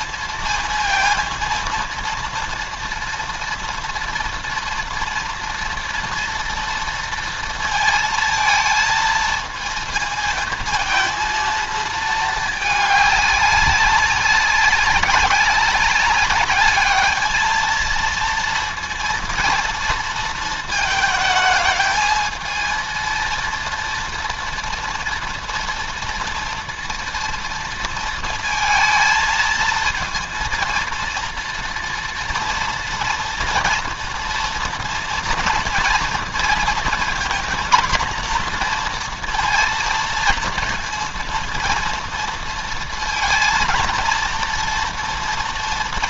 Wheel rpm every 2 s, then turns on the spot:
230, 230, 230, 230, 230, 220, 210, 190, 210, 230, 220, 230, 230, 230, 220, 230, 230, 230, 240, 240, 230, 230, 230.
none